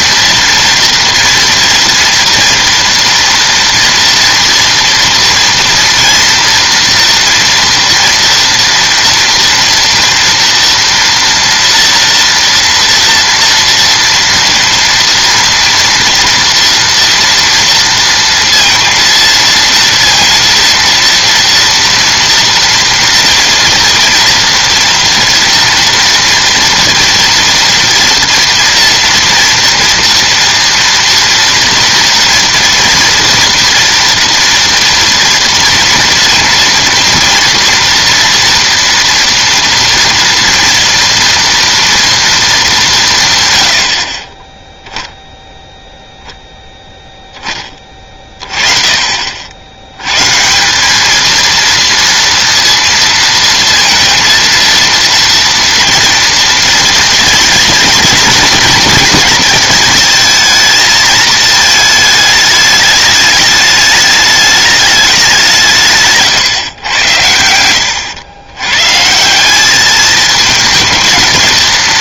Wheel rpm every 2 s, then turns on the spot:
230, 230, 230, 240, 240, 230, 230, 230, 240, 230, 230, 230, 230, 230, 230, 230, 230, 230, 230, 230, 240, 200, 10, 10, 30, 180, 230, 230, 230, 220, 230, 210, 210, 110, 120, 220.
none